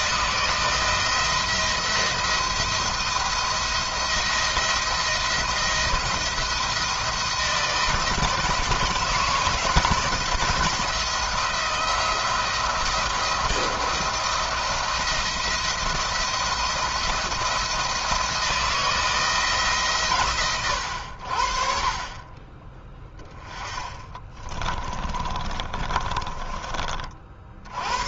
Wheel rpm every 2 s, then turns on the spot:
170, 170, 170, 160, 160, 170, 170, 170, 170, 160, 90, 20, 20, 30.
22-26